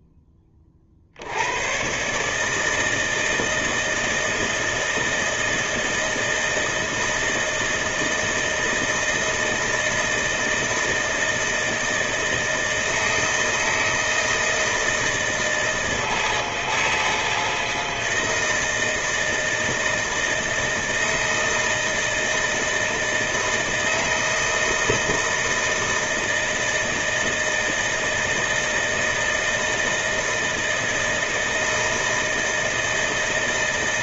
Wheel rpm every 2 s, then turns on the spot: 30, 150, 160, 160, 160, 160, 160, 160, 160, 160, 160, 160, 160, 160, 160, 160, 160.
none